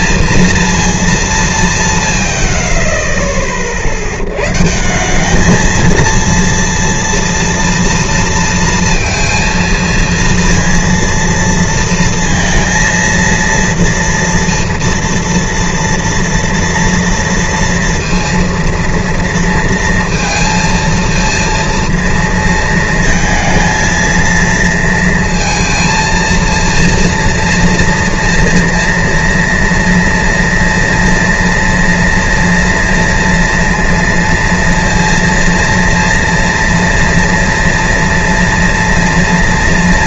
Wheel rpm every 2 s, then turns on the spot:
230, 70, 120, 230, 230, 230, 230, 230, 230, 230, 230, 230, 230, 230, 230, 230, 230, 230, 230, 230.
none